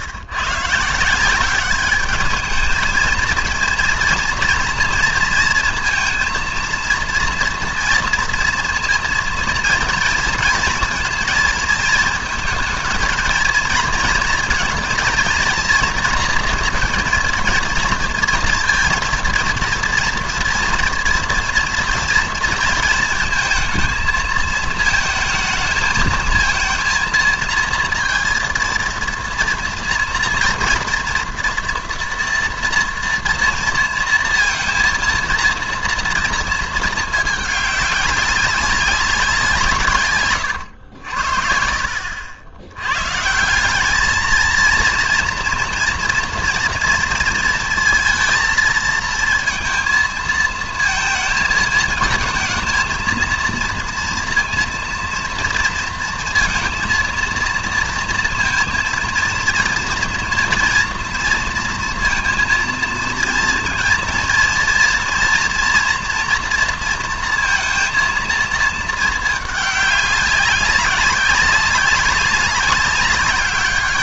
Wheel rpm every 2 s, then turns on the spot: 130, 210, 230, 230, 230, 230, 230, 230, 230, 230, 230, 230, 220, 230, 230, 230, 230, 230, 220, 190, 100, 100, 230, 230, 230, 230, 230, 230, 230, 230, 230, 230, 230, 230, 220, 190, 200.
none